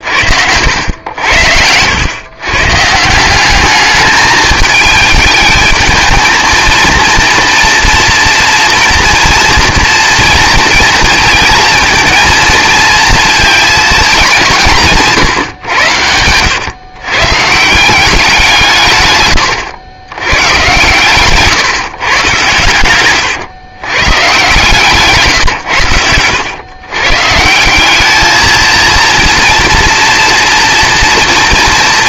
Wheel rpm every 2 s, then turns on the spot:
80, 140, 210, 230, 230, 230, 230, 170, 120, 170, 120, 120, 140, 120, 230, 230.
none